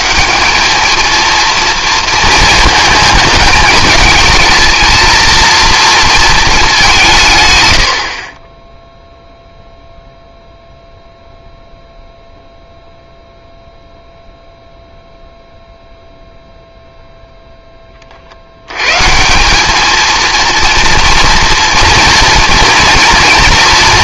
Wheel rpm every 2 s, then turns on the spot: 200, 220, 230, 200, 10, 0, 0, 0, 0, 90, 230, 230.
none